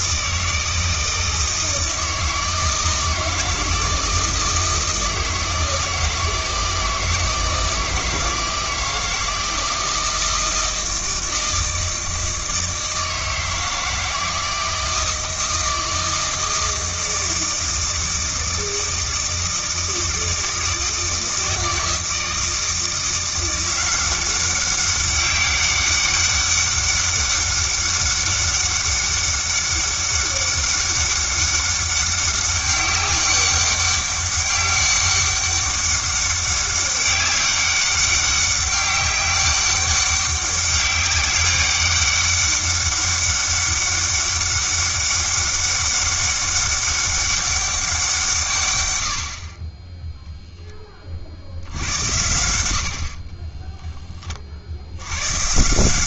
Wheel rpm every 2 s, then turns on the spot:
160, 160, 160, 160, 160, 160, 160, 160, 160, 160, 160, 170, 190, 200, 200, 200, 200, 200, 200, 200, 200, 200, 200, 200, 120, 20, 70, 70.
none